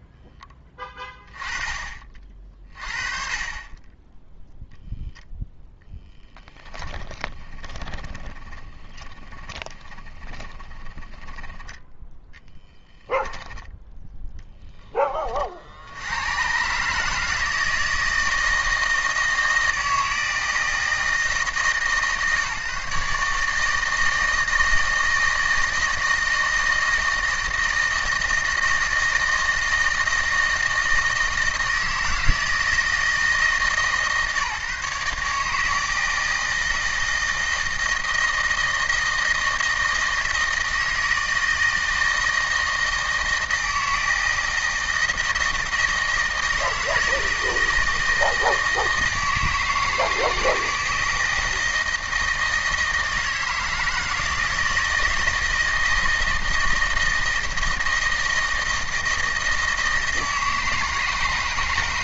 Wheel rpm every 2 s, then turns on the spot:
20, 40, 0, 20, 30, 20, 10, 20, 140, 160, 160, 140, 160, 160, 160, 160, 160, 140, 160, 160, 160, 160, 160, 160, 160, 160, 160, 160, 160, 160, 160.
6-12